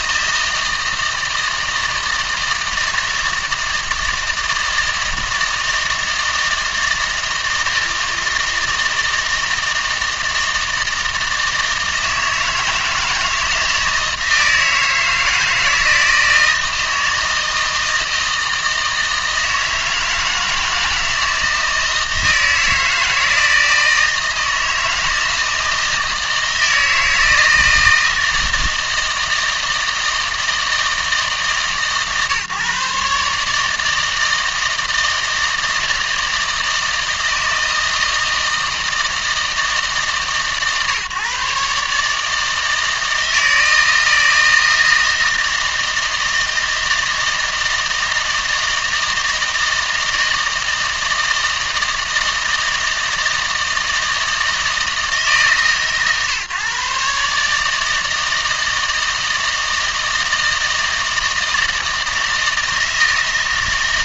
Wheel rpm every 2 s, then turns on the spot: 160, 160, 160, 160, 160, 160, 160, 160, 160, 160, 160, 160, 160, 160, 160, 160, 150, 160, 160, 160, 140, 160, 160, 160, 160, 160, 160, 160, 140, 160, 160, 160.
none